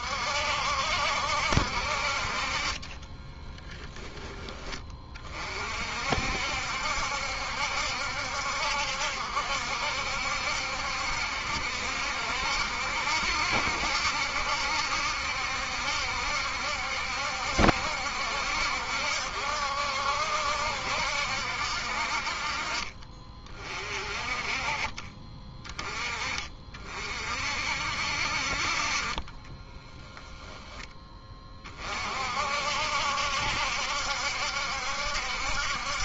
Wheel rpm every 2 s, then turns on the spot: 60, 40, 20, 70, 60, 70, 70, 70, 70, 70, 60, 40, 40, 30, 50, 10, 60, 70.
none